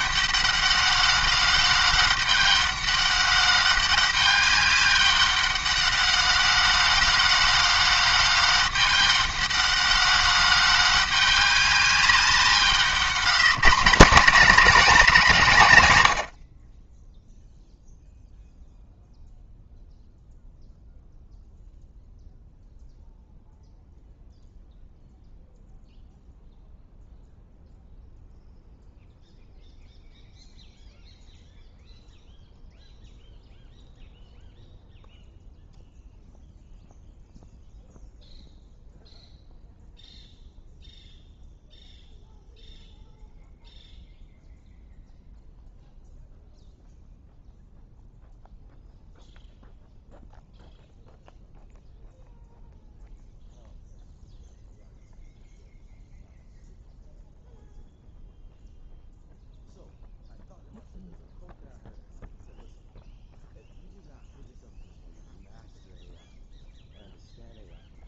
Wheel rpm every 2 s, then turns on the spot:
200, 200, 200, 200, 200, 200, 180, 240, 30, 0, 0, 0, 0, 0, 0, 0, 0, 0, 0, 0, 0, 0, 0, 0, 0, 0, 0, 0, 0, 0, 0, 0, 0, 0.
none